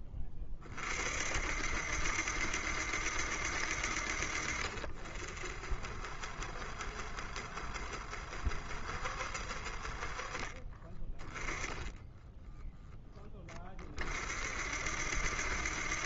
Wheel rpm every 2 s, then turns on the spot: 30, 70, 60, 60, 70, 30, 10, 50.
10-12